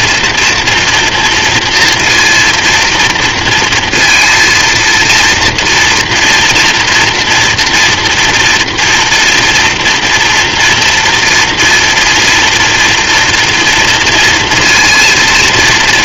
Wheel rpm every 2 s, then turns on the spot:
230, 230, 230, 230, 230, 230, 240, 230.
none